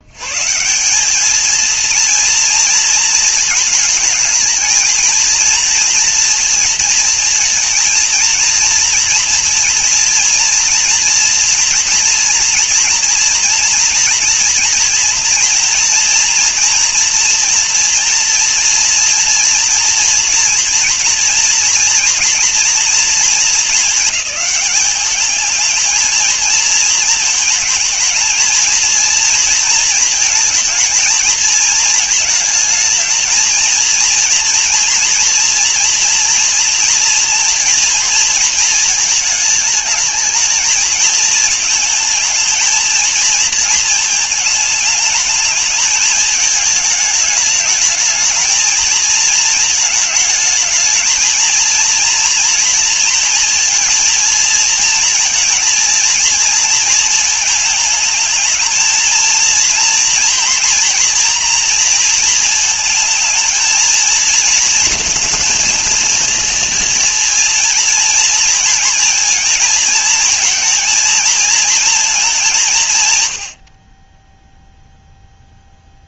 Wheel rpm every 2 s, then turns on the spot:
180, 230, 230, 230, 230, 230, 230, 230, 240, 230, 230, 230, 210, 220, 230, 220, 220, 230, 230, 220, 220, 230, 220, 210, 220, 220, 240, 230, 230, 230, 230, 220, 230, 230, 230, 220, 160, 0.
none